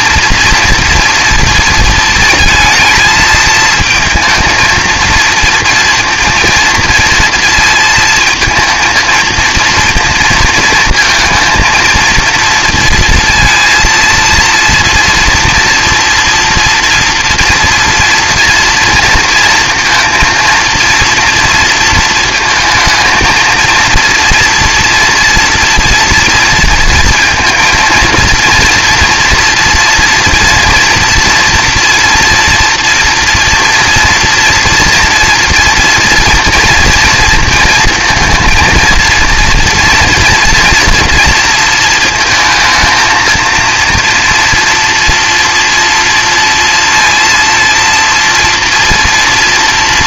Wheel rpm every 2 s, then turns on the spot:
230, 220, 230, 230, 230, 220, 230, 230, 230, 230, 230, 220, 240, 230, 230, 240, 230, 240, 230, 230, 230, 220, 230, 230, 230.
none